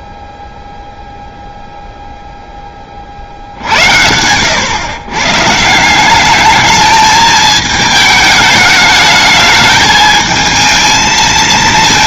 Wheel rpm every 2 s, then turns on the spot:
0, 20, 120, 210, 210, 220.
none